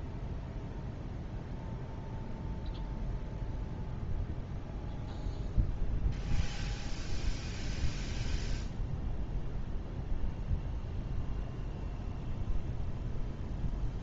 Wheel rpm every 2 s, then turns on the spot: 0, 0, 0, 0, 0, 0, 0.
none